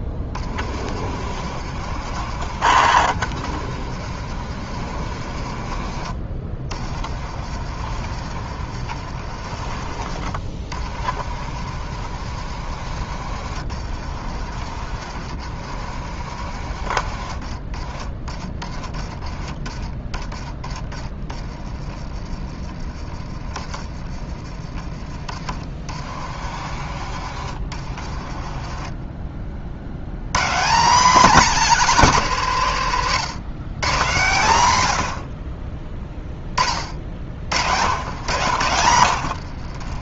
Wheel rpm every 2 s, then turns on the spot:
30, 70, 60, 40, 60, 50, 60, 60, 60, 30, 30, 30, 40, 60, 30, 190, 170, 130, 30, 100.
20-22 24-26 38-40